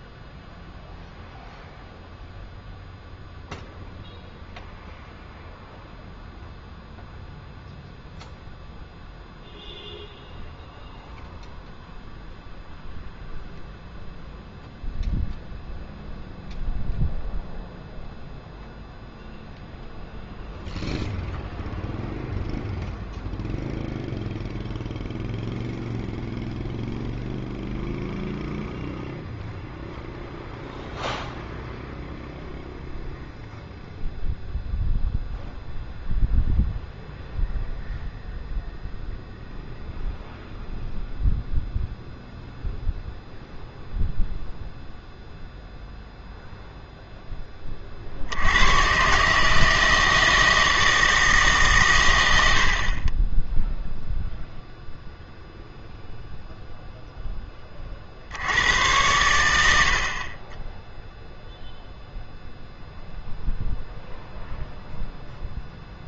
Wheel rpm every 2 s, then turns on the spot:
0, 0, 0, 0, 0, 0, 0, 0, 0, 0, 0, 0, 0, 0, 0, 0, 0, 0, 0, 0, 0, 0, 0, 0, 90, 160, 50, 0, 0, 90, 20, 0, 0.
none